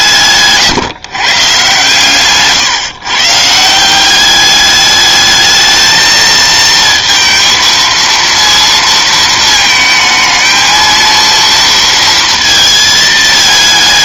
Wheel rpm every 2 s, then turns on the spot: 140, 150, 200, 220, 230, 220, 230.
0-2